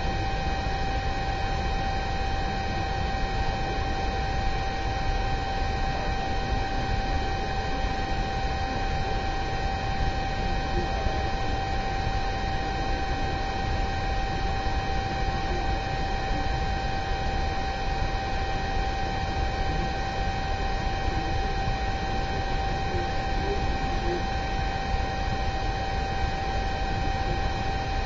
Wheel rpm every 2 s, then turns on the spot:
0, 0, 0, 0, 0, 0, 0, 0, 0, 0, 0, 0, 0, 0.
none